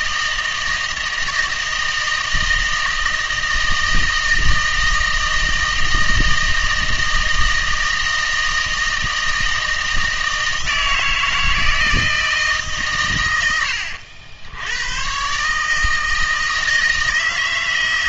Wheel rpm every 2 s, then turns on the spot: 160, 160, 160, 160, 160, 160, 140, 90, 160.
none